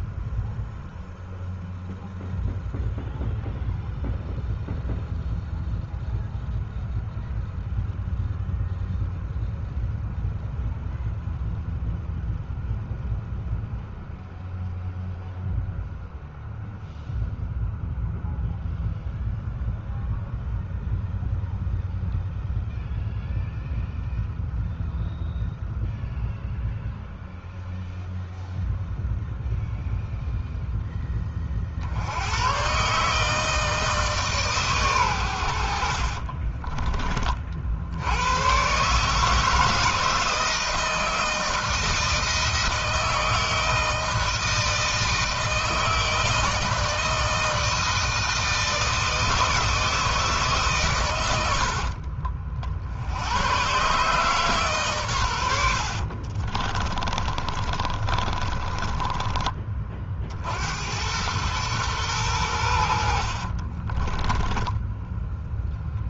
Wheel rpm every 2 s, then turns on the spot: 0, 0, 0, 0, 0, 0, 0, 0, 0, 0, 0, 0, 0, 0, 0, 20, 140, 120, 30, 150, 160, 160, 160, 160, 160, 100, 80, 110, 40, 30, 100, 60, 10.
56-60 62-64